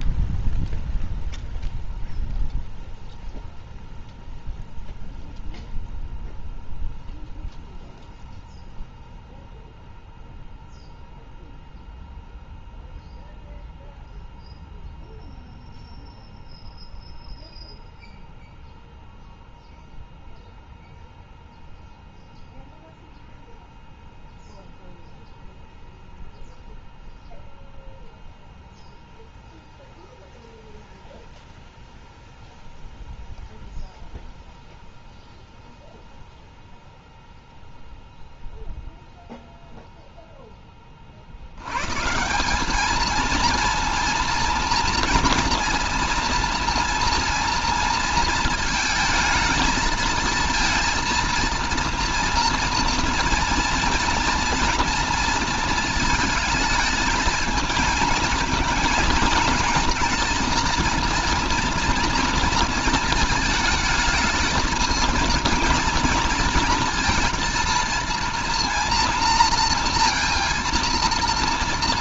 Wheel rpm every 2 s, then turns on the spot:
0, 0, 0, 0, 0, 0, 0, 0, 0, 0, 0, 0, 0, 0, 0, 0, 0, 0, 0, 0, 30, 200, 230, 230, 220, 230, 230, 230, 220, 220, 230, 230, 230, 230, 230, 230.
none